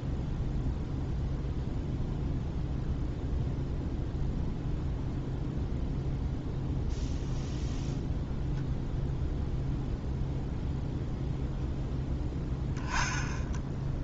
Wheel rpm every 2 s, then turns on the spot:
0, 0, 0, 0, 0, 0, 10.
none